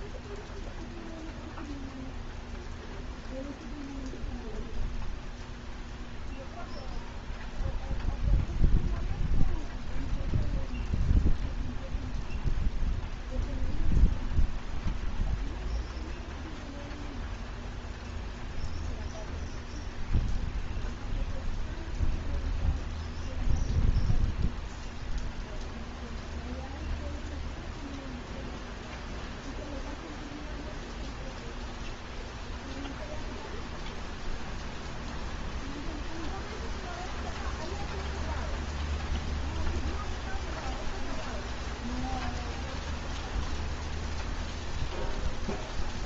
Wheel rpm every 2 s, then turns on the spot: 0, 0, 0, 0, 0, 0, 0, 0, 0, 0, 0, 0, 0, 0, 0, 0, 0, 0, 0, 0, 0, 0, 0.
none